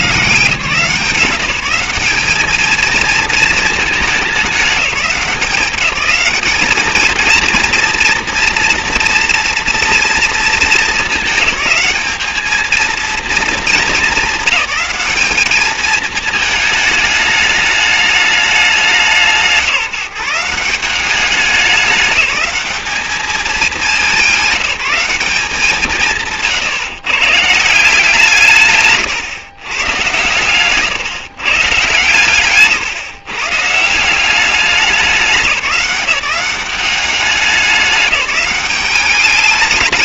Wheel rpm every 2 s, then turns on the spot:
170, 220, 210, 210, 240, 220, 220, 210, 220, 210, 180, 210, 200, 140, 170, 120, 150, 190, 190, 200.
none